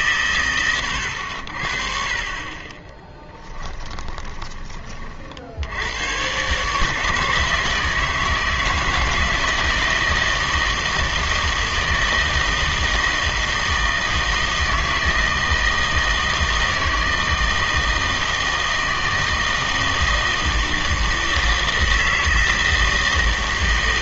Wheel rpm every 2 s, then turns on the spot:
110, 30, 20, 130, 160, 160, 160, 160, 160, 160, 160, 160.
2-4